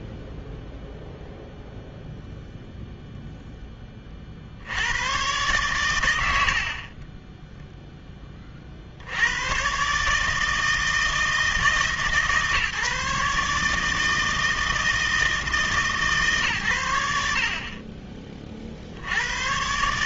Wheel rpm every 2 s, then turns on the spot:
0, 0, 50, 40, 20, 150, 150, 160, 140, 30.
6-8